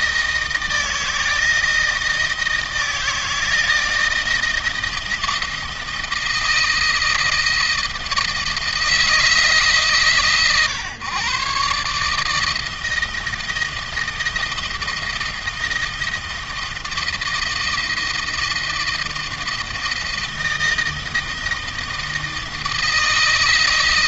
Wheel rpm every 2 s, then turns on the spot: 160, 160, 160, 170, 160, 130, 160, 160, 160, 160, 160, 160.
none